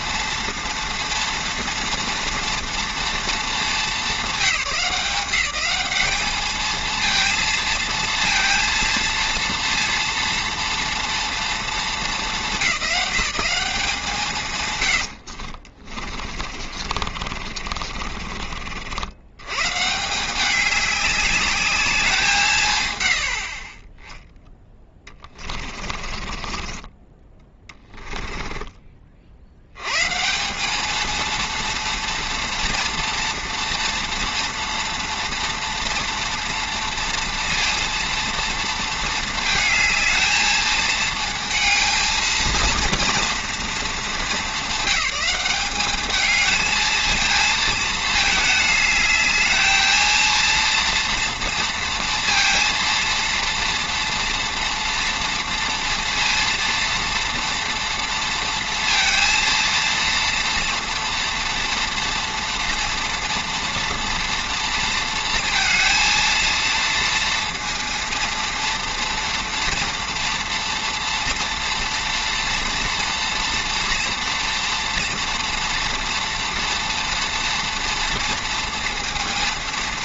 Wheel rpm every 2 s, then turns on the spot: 230, 230, 190, 220, 230, 230, 200, 80, 40, 60, 190, 140, 10, 20, 20, 200, 230, 240, 230, 230, 220, 230, 190, 220, 210, 230, 230, 240, 240, 230, 230, 230, 230, 230, 230, 230, 230, 230, 230, 230.
16-18 26-30